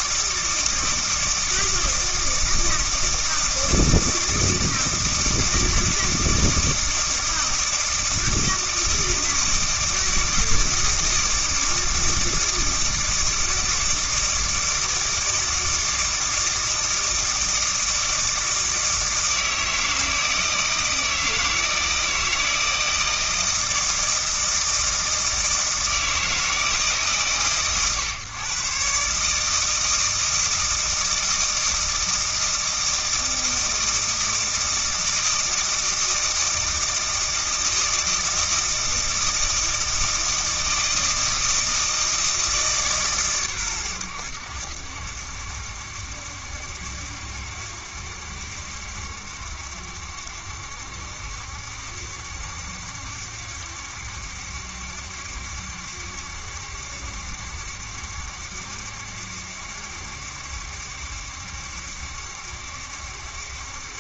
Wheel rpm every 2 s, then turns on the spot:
160, 160, 160, 160, 160, 160, 160, 160, 160, 160, 160, 160, 160, 140, 130, 160, 160, 160, 160, 160, 160, 150, 70, 70, 70, 70, 70, 70, 70, 70, 70, 70.
none